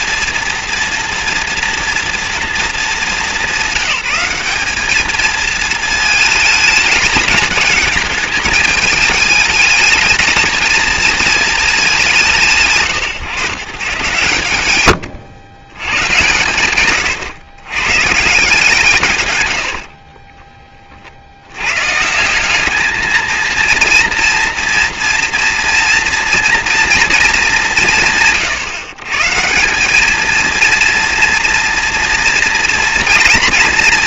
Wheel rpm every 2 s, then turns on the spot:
230, 230, 190, 210, 210, 220, 160, 120, 120, 160, 40, 210, 230, 230, 130, 230, 230.
16-18